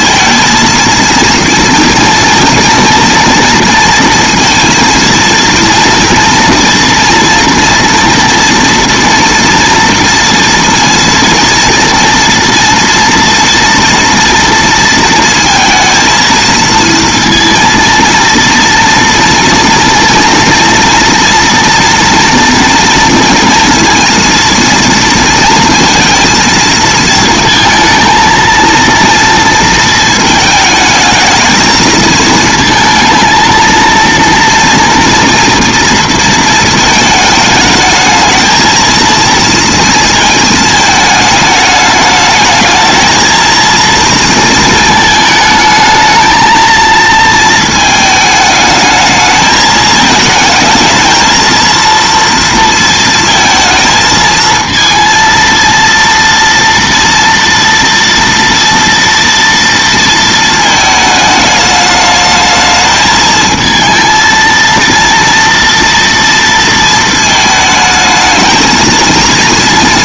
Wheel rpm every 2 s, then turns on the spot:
230, 240, 230, 230, 230, 230, 230, 230, 230, 230, 230, 230, 230, 230, 230, 220, 220, 230, 230, 220, 220, 220, 220, 230, 220, 220, 230, 220, 230, 230, 220, 220, 230, 230, 220.
none